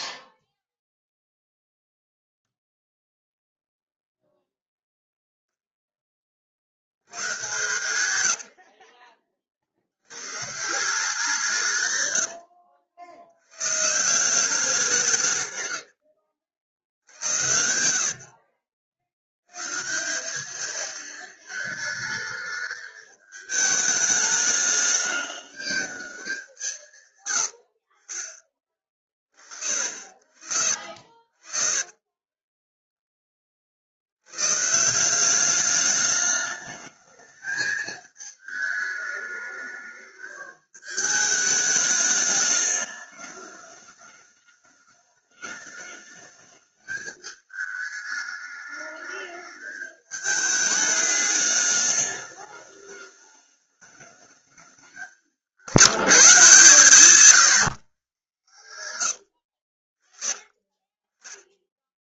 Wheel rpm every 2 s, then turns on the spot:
0, 0, 0, 60, 80, 160, 80, 180, 90, 60, 210, 220, 210, 180, 30, 60, 20, 140, 210, 220, 210, 210, 210, 220, 210, 210, 210, 200, 160, 120, 40.
8-10 30-34 60-62